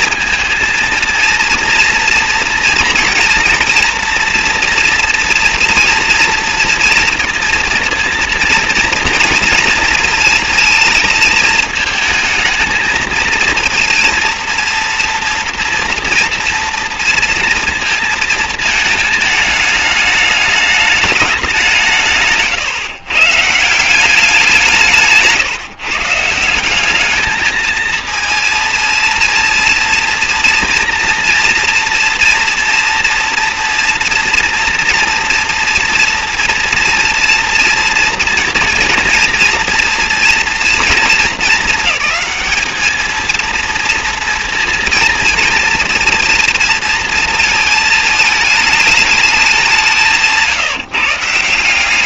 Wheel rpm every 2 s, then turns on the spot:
230, 230, 230, 230, 230, 220, 220, 230, 230, 220, 210, 130, 170, 200, 230, 240, 240, 240, 230, 230, 220, 220, 230, 230, 210, 150.
none